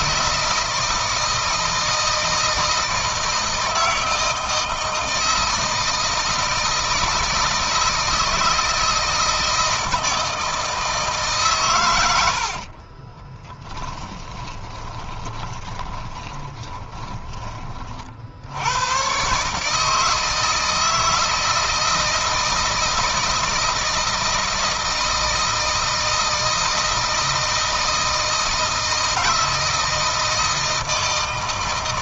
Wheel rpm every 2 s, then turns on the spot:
170, 160, 160, 160, 160, 160, 60, 30, 10, 90, 160, 160, 160, 160, 160, 160.
12-18